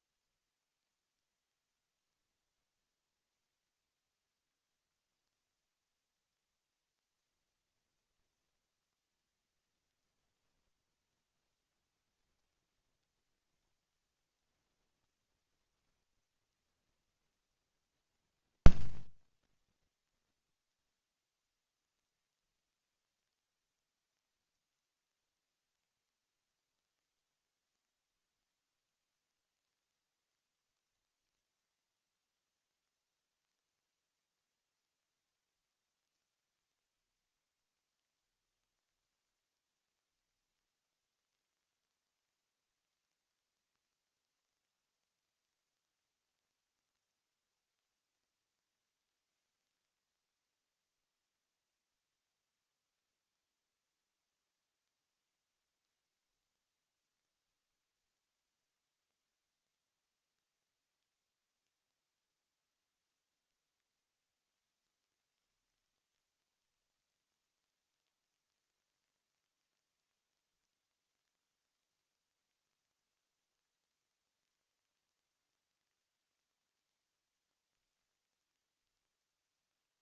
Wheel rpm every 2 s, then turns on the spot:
0, 0, 0, 0, 0, 0, 0, 0, 0, 0, 0, 0, 0, 0, 0, 0, 0, 0, 0, 0, 0, 0, 0, 0, 0, 0, 0, 0, 0, 0, 0, 0, 0, 0, 0, 0, 0, 0, 0, 0.
none